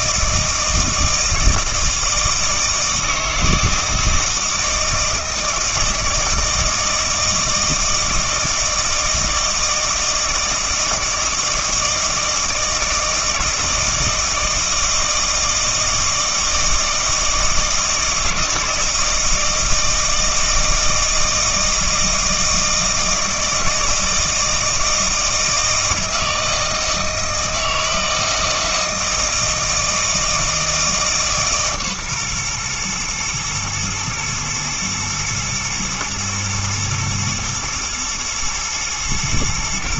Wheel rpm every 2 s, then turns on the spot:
160, 160, 160, 160, 160, 160, 160, 160, 160, 160, 160, 160, 160, 160, 160, 160, 120, 110, 110, 110.
none